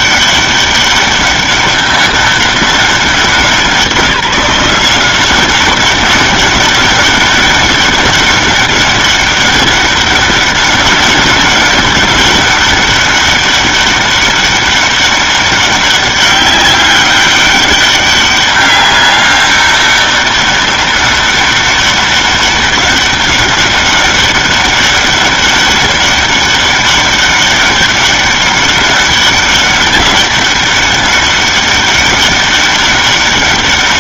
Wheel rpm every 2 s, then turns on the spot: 200, 200, 180, 190, 200, 200, 200, 200, 200, 200, 200, 200, 200, 200, 200, 200, 200.
none